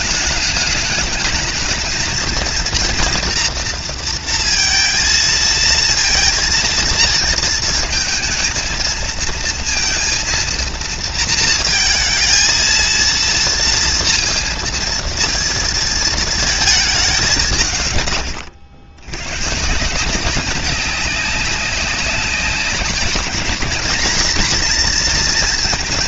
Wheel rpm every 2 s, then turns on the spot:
210, 230, 230, 230, 220, 230, 230, 230, 210, 90, 190, 200, 230.
none